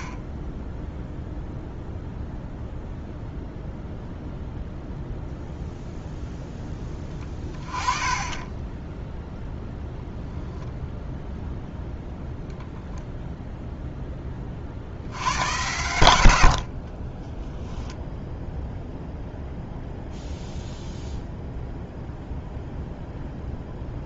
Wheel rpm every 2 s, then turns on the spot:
20, 0, 0, 10, 10, 0, 0, 40, 60, 0, 0, 0.
none